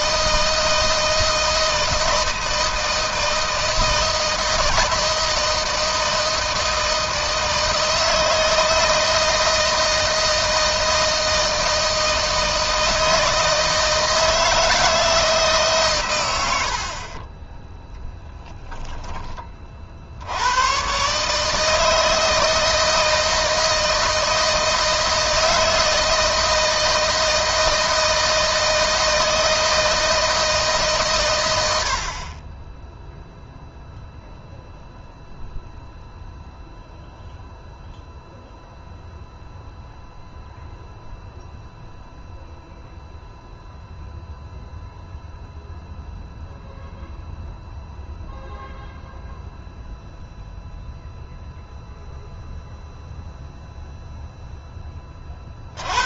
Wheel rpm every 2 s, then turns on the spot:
160, 160, 160, 160, 160, 160, 160, 160, 60, 10, 120, 160, 160, 160, 160, 140, 0, 0, 0, 0, 0, 0, 0, 0, 0, 0, 0, 20.
none